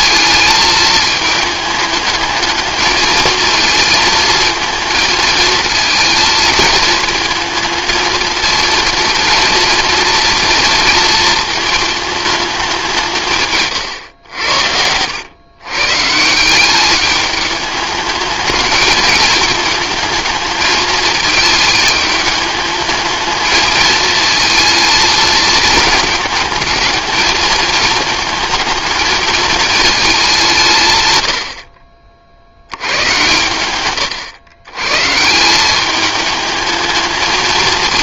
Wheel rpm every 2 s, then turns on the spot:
220, 220, 220, 220, 230, 230, 180, 80, 200, 220, 220, 220, 220, 210, 220, 130, 100, 130, 220.
14-16